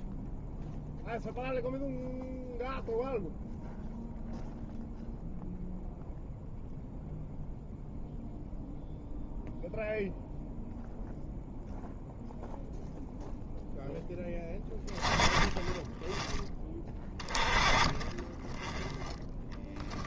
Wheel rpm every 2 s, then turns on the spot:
0, 0, 0, 0, 0, 0, 0, 10, 20, 10.
none